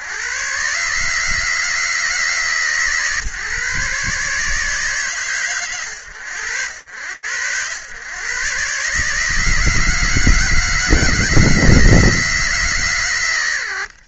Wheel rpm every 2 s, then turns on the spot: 130, 150, 150, 100, 140, 160, 140.
none